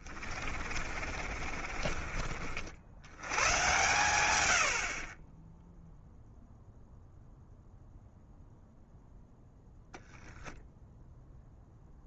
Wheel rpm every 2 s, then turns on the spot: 40, 70, 40, 0, 0, 0.
0-2